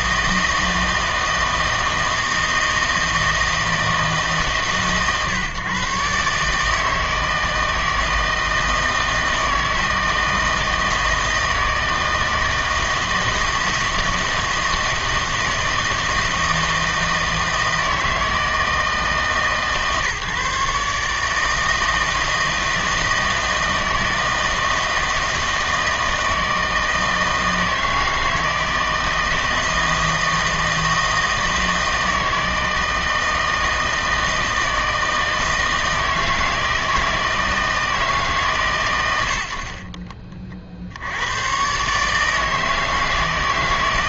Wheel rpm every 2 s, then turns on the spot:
160, 160, 150, 150, 160, 160, 160, 160, 160, 160, 140, 160, 160, 160, 160, 160, 160, 160, 160, 140, 50, 160.
none